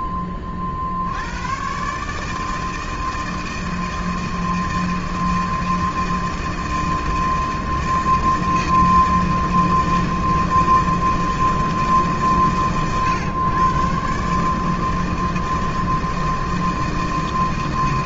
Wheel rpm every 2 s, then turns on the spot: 80, 160, 160, 160, 160, 160, 120, 160, 160.
none